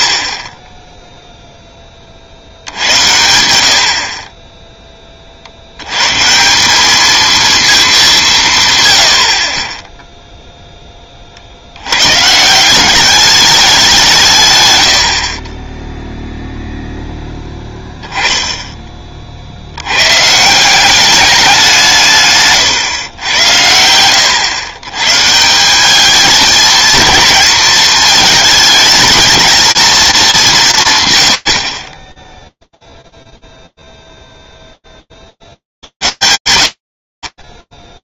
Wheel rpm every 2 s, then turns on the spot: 30, 70, 10, 180, 160, 0, 150, 120, 0, 10, 160, 140, 110, 220, 220, 170, 0, 0, 70.
none